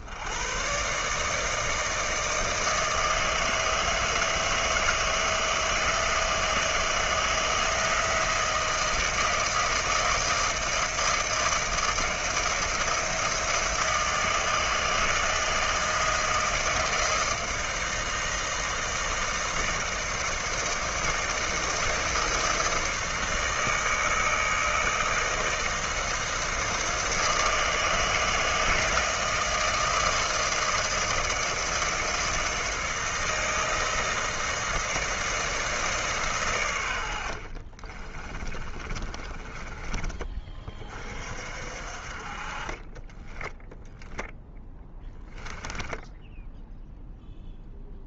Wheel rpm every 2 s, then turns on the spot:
50, 160, 160, 160, 170, 160, 170, 160, 160, 160, 160, 160, 160, 160, 160, 160, 160, 160, 140, 40, 30, 40, 10, 10.
38-40 46-48